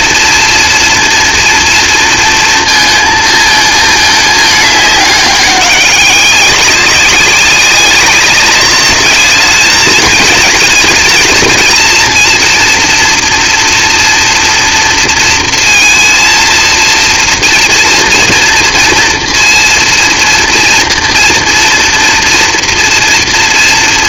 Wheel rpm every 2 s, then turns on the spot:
230, 230, 210, 190, 200, 220, 230, 230, 230, 230, 240, 230.
none